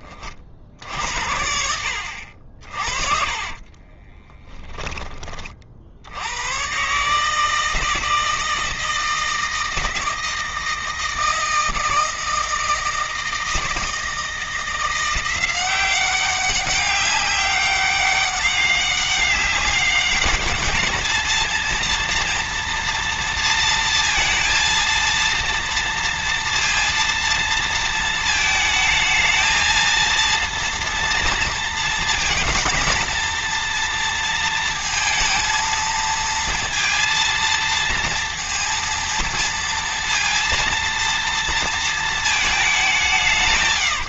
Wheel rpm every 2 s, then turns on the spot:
70, 50, 20, 130, 160, 160, 160, 170, 200, 200, 220, 230, 230, 230, 220, 230, 230, 230, 230, 230, 230, 170.
2-4